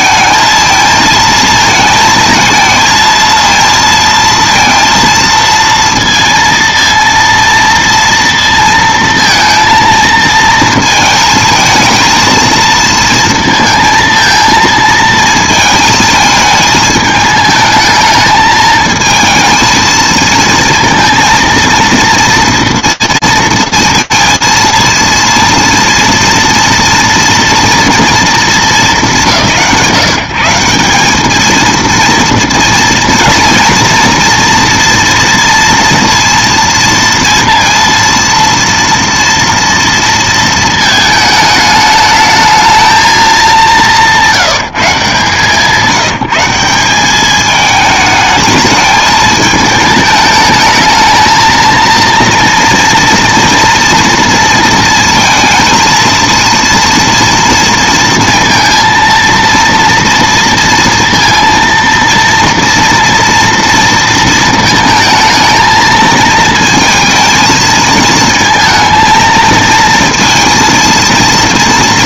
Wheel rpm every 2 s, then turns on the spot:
220, 220, 230, 230, 230, 220, 230, 230, 220, 220, 230, 230, 230, 230, 190, 190, 230, 230, 230, 230, 220, 220, 170, 190, 220, 220, 230, 230, 230, 230, 230, 240, 230, 230, 230, 230.
none